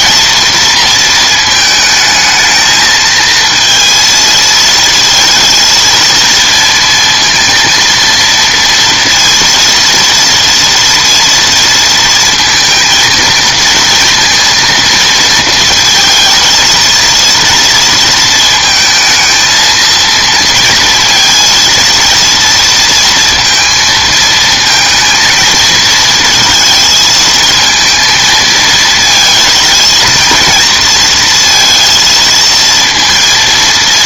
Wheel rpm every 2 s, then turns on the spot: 230, 220, 220, 230, 230, 230, 220, 230, 230, 220, 230, 230, 230, 230, 230, 230, 230.
none